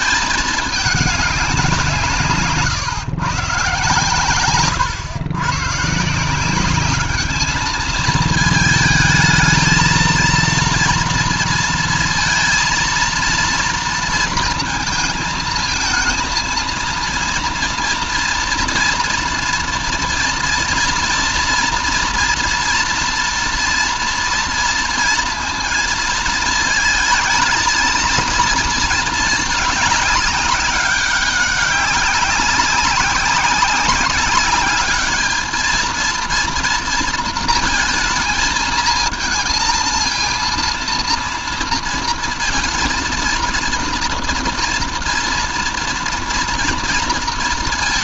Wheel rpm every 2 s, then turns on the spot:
210, 150, 130, 200, 220, 230, 230, 230, 230, 230, 230, 230, 230, 220, 230, 200, 190, 200, 230, 220, 230, 230, 230, 230.
4-6